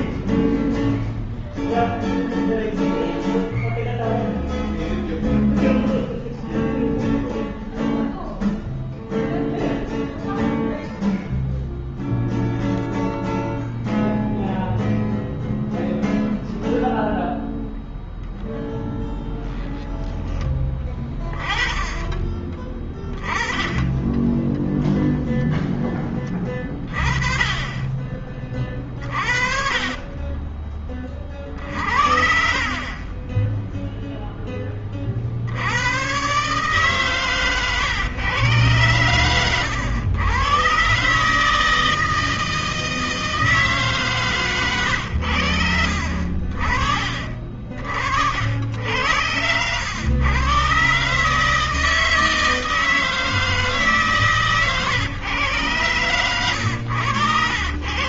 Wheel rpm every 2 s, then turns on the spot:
0, 0, 0, 0, 0, 0, 0, 0, 0, 0, 20, 10, 10, 20, 30, 40, 10, 80, 130, 110, 160, 160, 80, 40, 90, 150, 150, 110, 80.
28-30 46-48